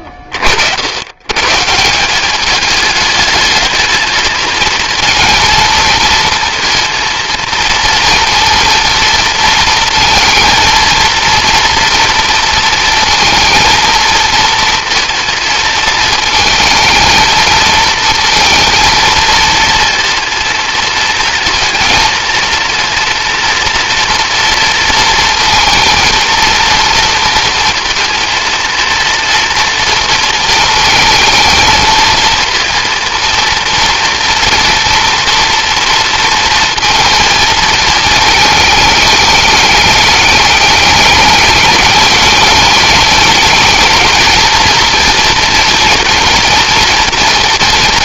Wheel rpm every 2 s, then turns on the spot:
120, 210, 230, 230, 220, 230, 230, 230, 220, 220, 230, 230, 230, 230, 230, 220, 230, 230, 230, 210, 220, 210, 230, 230.
none